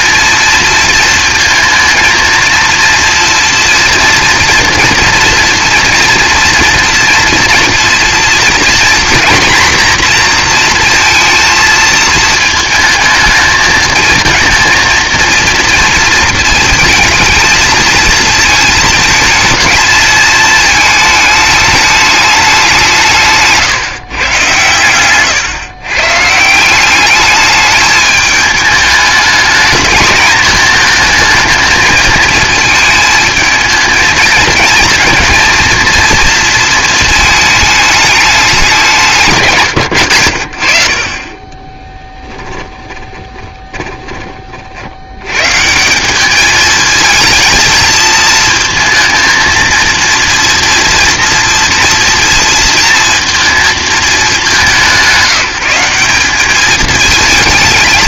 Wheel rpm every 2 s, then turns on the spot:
230, 230, 230, 230, 240, 240, 220, 230, 220, 220, 220, 190, 120, 180, 210, 220, 230, 220, 230, 200, 50, 10, 50, 220, 230, 240, 230, 190, 210.
24-26 42-44